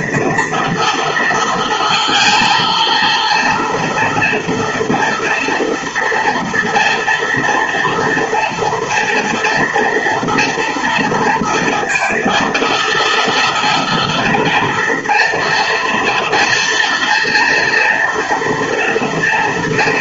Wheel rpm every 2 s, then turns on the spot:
230, 230, 230, 230, 230, 230, 230, 240, 230, 230.
none